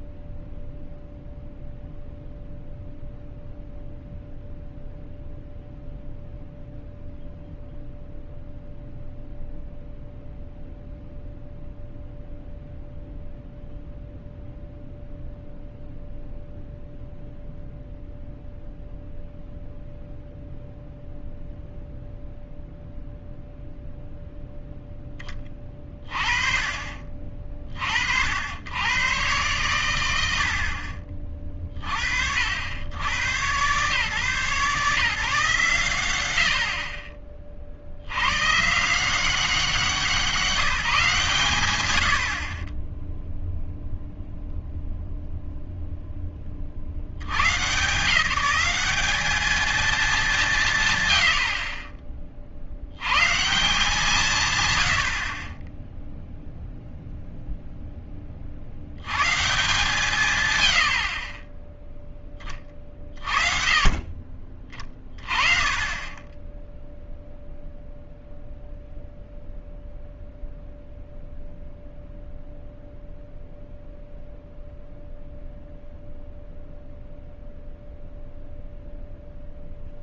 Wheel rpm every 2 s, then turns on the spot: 0, 0, 0, 0, 0, 0, 0, 0, 0, 0, 0, 0, 0, 30, 80, 70, 80, 140, 70, 130, 180, 40, 0, 50, 190, 170, 50, 130, 0, 40, 120, 20, 30, 10, 0, 0, 0, 0, 0, 0.
none